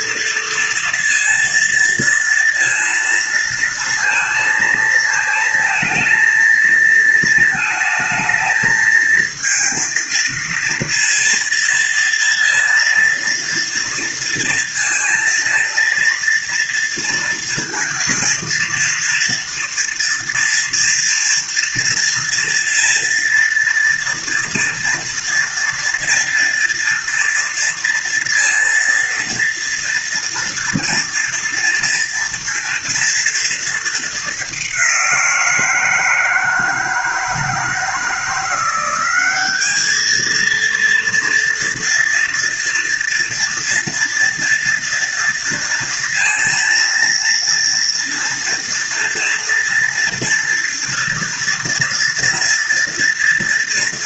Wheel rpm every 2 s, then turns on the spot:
230, 230, 220, 220, 220, 230, 230, 230, 230, 230, 230, 230, 230, 230, 230, 230, 230, 180, 160, 190, 230, 230, 230, 230, 230, 230, 230.
none